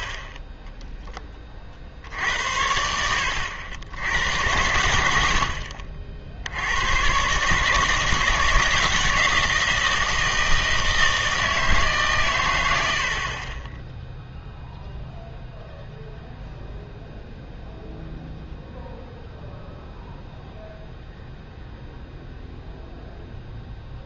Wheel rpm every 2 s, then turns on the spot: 10, 80, 90, 90, 160, 160, 100, 0, 0, 0, 0, 0.
none